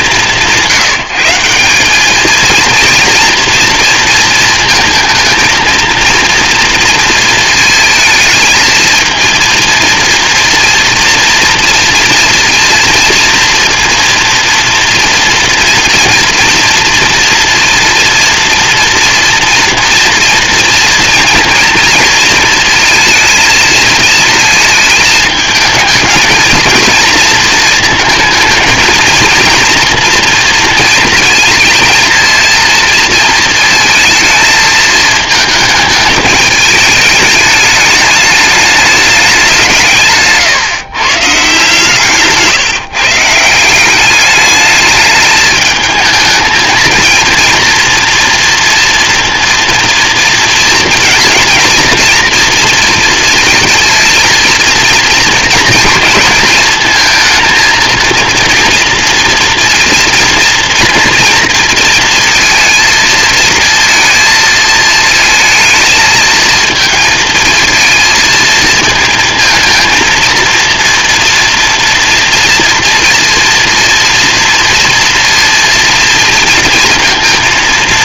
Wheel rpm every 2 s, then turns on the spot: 170, 230, 220, 230, 220, 240, 230, 230, 240, 240, 230, 230, 220, 230, 220, 230, 230, 220, 210, 210, 150, 150, 210, 230, 230, 230, 230, 230, 230, 230, 230, 230, 220, 220, 220, 230, 230, 230, 230.
none